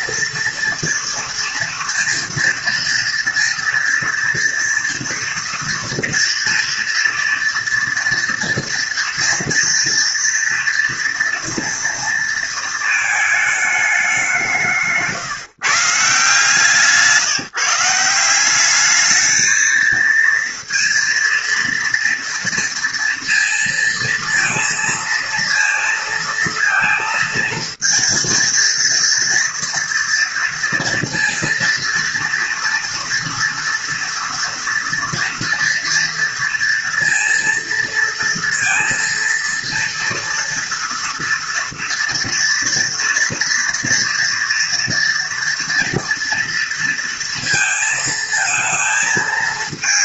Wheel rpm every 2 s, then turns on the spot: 230, 230, 230, 230, 230, 230, 220, 170, 160, 200, 230, 230, 230, 230, 230, 230, 230, 230, 230, 230, 230, 230, 230, 230, 220.
none